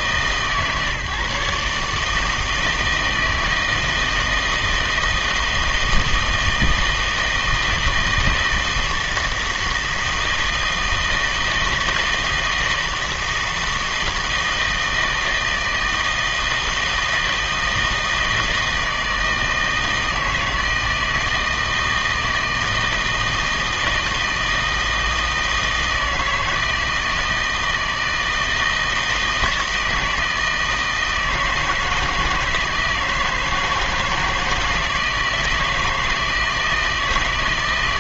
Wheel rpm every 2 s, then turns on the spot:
150, 160, 160, 160, 160, 160, 160, 160, 160, 160, 160, 160, 160, 160, 160, 160, 160, 160, 160.
none